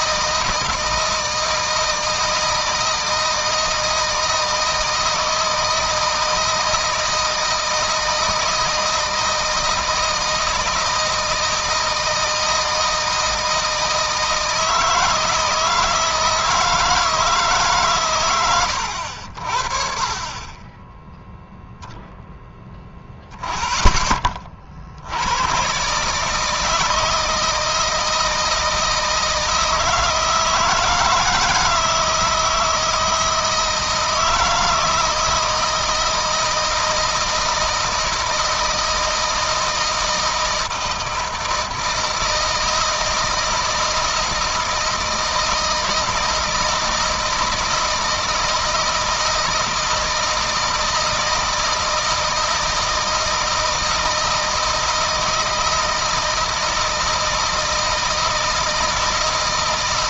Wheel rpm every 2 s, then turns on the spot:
160, 160, 160, 160, 160, 160, 160, 160, 160, 70, 10, 0, 60, 160, 160, 160, 160, 160, 160, 160, 160, 160, 160, 160, 160, 160, 160, 160, 160, 160.
none